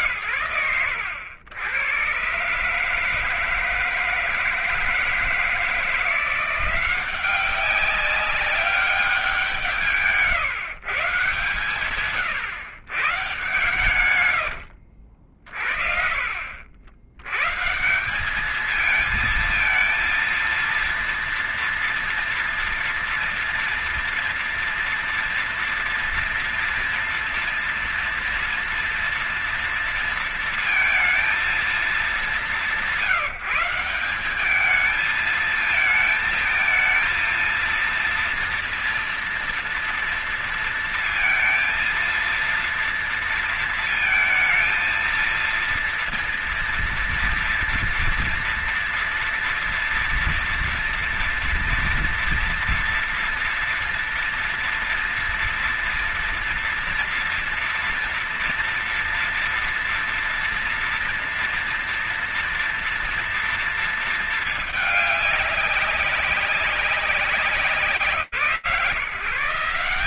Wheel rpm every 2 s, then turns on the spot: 100, 160, 160, 190, 170, 120, 130, 60, 130, 220, 230, 230, 230, 230, 230, 220, 180, 220, 230, 230, 230, 230, 230, 230, 230, 240, 230, 230, 230, 230, 230, 230, 210, 200, 170.
none